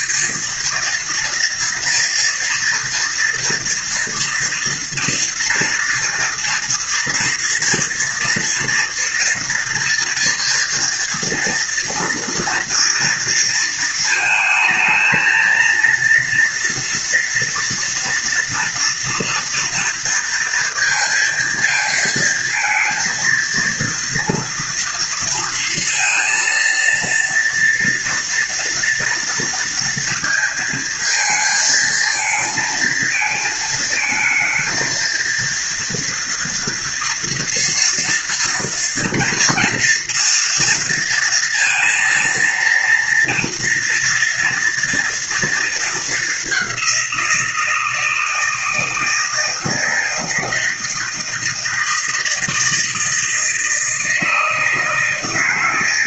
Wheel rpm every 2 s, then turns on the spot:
230, 230, 230, 230, 230, 230, 230, 230, 230, 230, 230, 230, 230, 230, 230, 220, 220, 230, 230, 230, 230, 230, 230, 190, 160, 160, 160, 160.
none